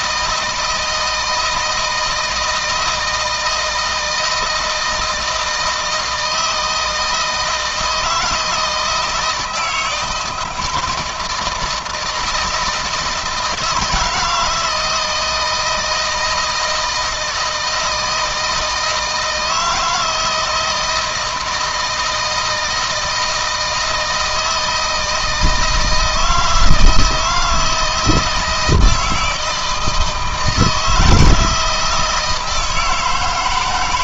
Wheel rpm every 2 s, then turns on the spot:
160, 160, 160, 160, 160, 160, 160, 160, 160, 160, 160, 160, 160, 160, 160, 170, 160.
none